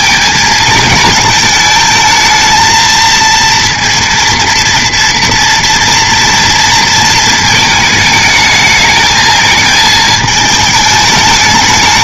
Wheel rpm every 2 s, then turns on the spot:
220, 230, 230, 230, 220, 210.
none